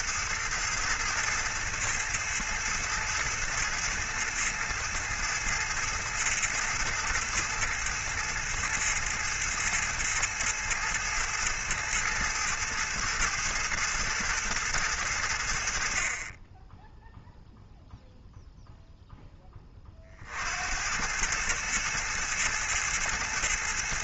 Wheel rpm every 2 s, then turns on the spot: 110, 110, 110, 110, 110, 110, 110, 100, 10, 0, 80, 110.
none